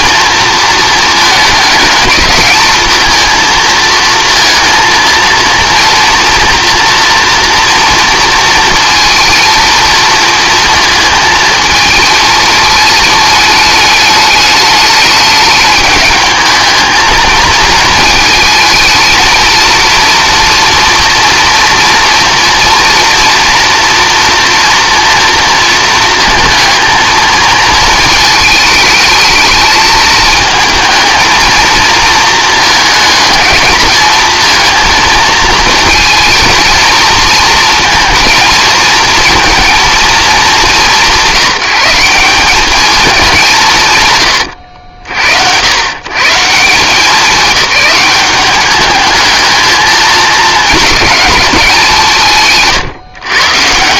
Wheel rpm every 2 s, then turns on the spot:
230, 220, 230, 230, 230, 220, 220, 210, 220, 230, 230, 240, 230, 220, 220, 220, 220, 220, 230, 230, 180, 210, 70, 180, 210, 210, 140.
52-54